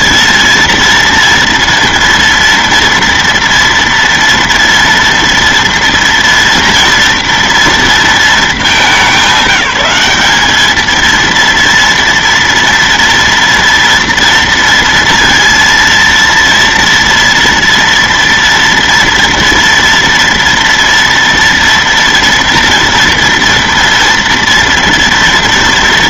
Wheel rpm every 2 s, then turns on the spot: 230, 230, 230, 230, 210, 210, 230, 230, 230, 230, 230, 230, 230.
none